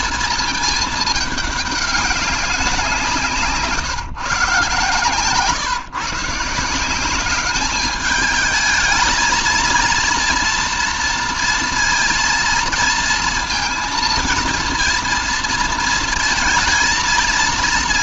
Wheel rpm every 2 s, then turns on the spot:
220, 180, 130, 170, 210, 230, 230, 230, 220.
none